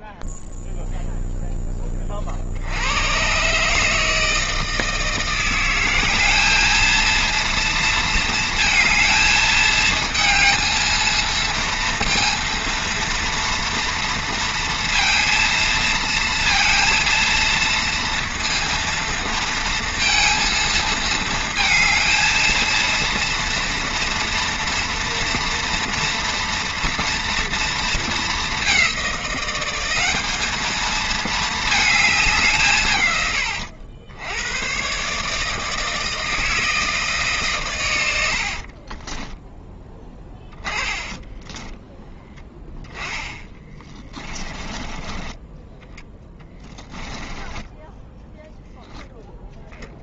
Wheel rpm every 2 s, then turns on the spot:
0, 30, 160, 190, 230, 220, 230, 230, 220, 230, 230, 220, 230, 230, 210, 210, 170, 100, 160, 50, 20, 10, 20, 10, 0.
38-44 46-48